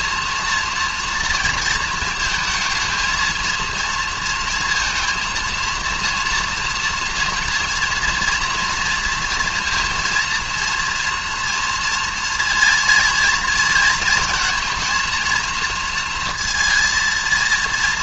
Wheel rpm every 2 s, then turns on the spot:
230, 220, 230, 230, 230, 230, 230, 230, 230.
none